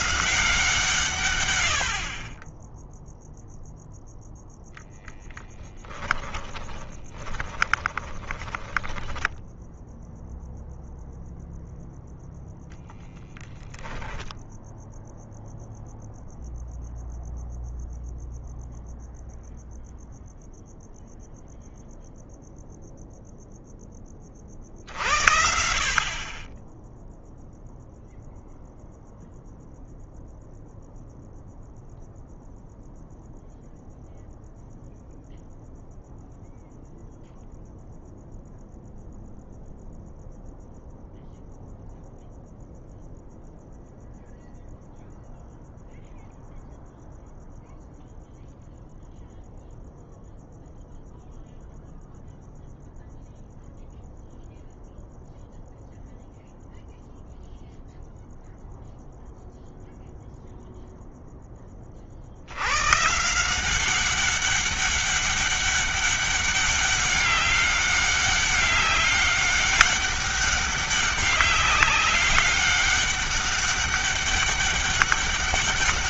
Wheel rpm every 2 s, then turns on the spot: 150, 10, 0, 20, 20, 0, 0, 0, 0, 0, 0, 0, 50, 20, 0, 0, 0, 0, 0, 0, 0, 0, 0, 0, 0, 0, 0, 0, 0, 0, 0, 90, 200, 200, 200, 200, 200, 190.
6-10